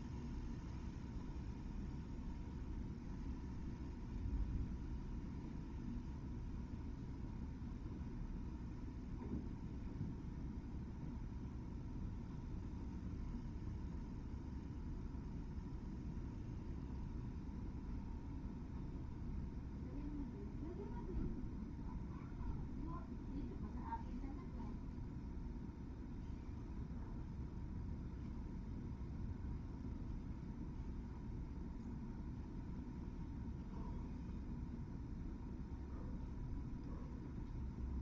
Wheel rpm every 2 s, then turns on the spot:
0, 0, 0, 0, 0, 0, 0, 0, 0, 0, 0, 0, 0, 0, 0, 0, 0, 0, 0.
none